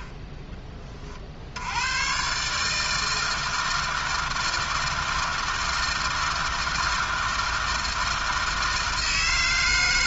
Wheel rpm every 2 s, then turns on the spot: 20, 150, 160, 160, 160.
none